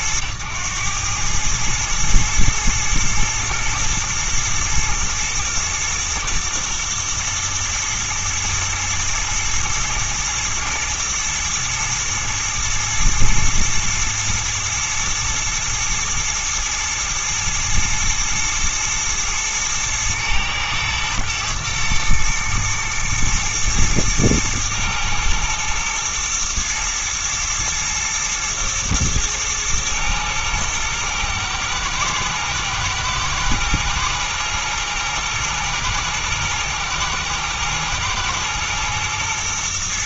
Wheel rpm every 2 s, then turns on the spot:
110, 110, 110, 120, 120, 110, 120, 120, 110, 110, 110, 110, 110, 120, 110, 110, 110, 120, 110, 110.
none